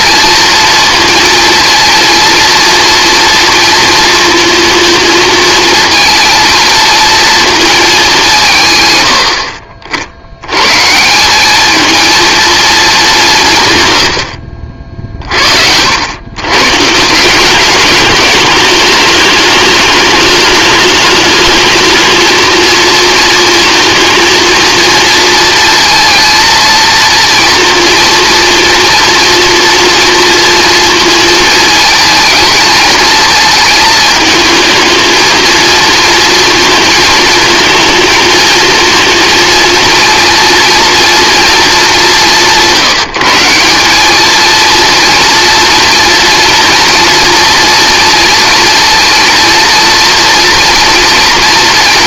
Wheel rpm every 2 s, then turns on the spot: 230, 230, 230, 230, 140, 130, 220, 60, 130, 220, 210, 230, 230, 230, 230, 230, 230, 230, 230, 230, 230, 180, 230, 230, 230, 230.
none